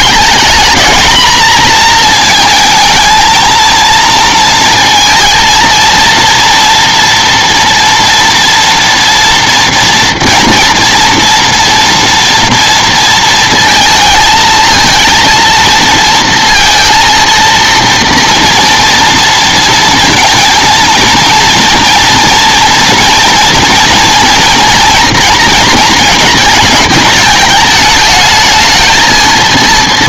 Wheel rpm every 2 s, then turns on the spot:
220, 220, 230, 230, 230, 230, 230, 220, 230, 230, 230, 240, 230, 220, 220.
none